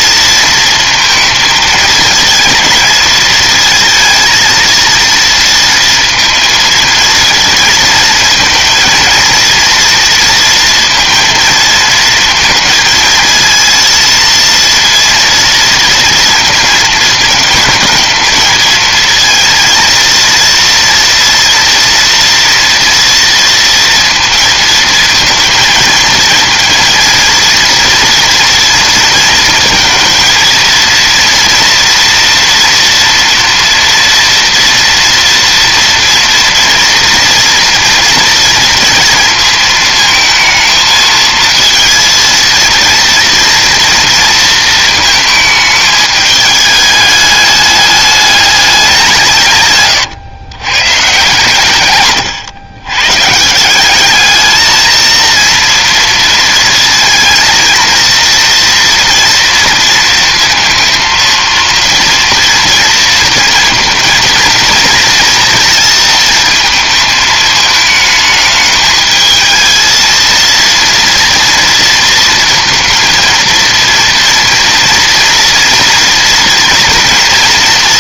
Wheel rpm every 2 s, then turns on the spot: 230, 220, 230, 230, 220, 230, 230, 230, 230, 230, 230, 230, 230, 230, 230, 230, 230, 230, 230, 230, 220, 230, 220, 210, 200, 120, 120, 220, 230, 230, 230, 230, 230, 220, 220, 230, 220, 230, 230.
none